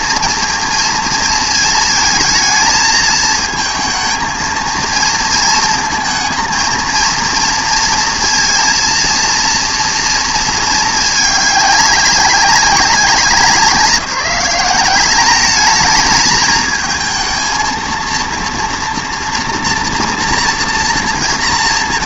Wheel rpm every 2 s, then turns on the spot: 230, 220, 230, 230, 230, 220, 180, 190, 220, 230, 230.
none